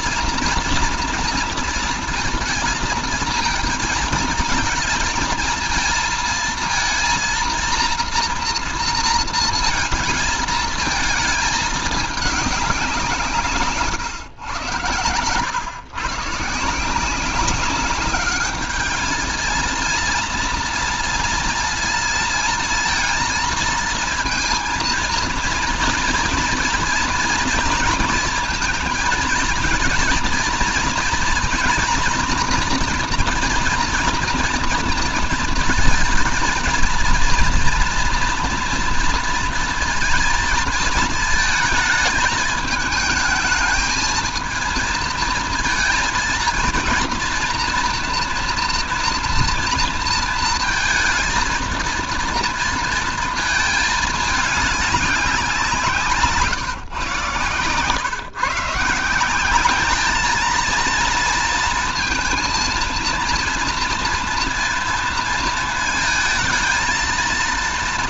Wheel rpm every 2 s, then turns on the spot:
240, 230, 230, 230, 240, 230, 200, 100, 150, 210, 230, 230, 230, 230, 230, 240, 230, 230, 230, 240, 230, 210, 220, 230, 230, 230, 230, 210, 150, 160, 220, 230, 230, 230.
none